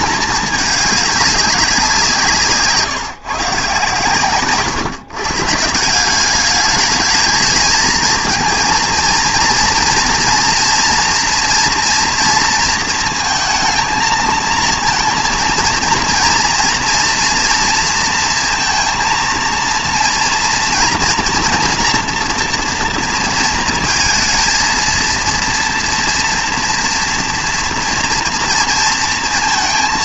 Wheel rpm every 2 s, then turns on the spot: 210, 150, 130, 210, 230, 230, 230, 220, 240, 230, 230, 230, 220, 230, 230.
none